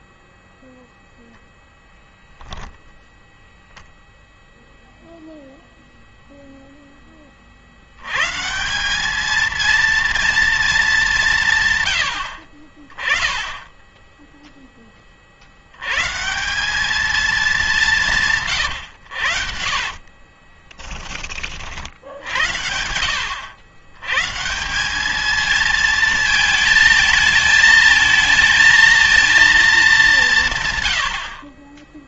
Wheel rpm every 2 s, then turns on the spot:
0, 0, 0, 0, 160, 220, 40, 10, 180, 140, 20, 80, 180, 220, 220, 130.
20-22